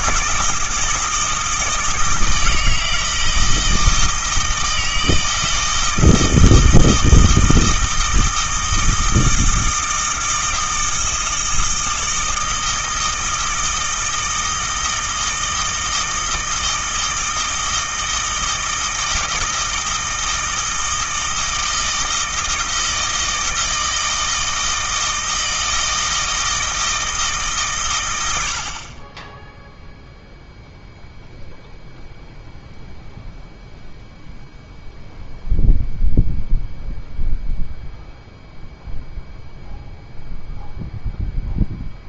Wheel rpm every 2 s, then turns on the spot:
160, 160, 160, 160, 160, 160, 160, 160, 160, 160, 160, 160, 160, 160, 50, 0, 0, 0, 0, 0, 0.
none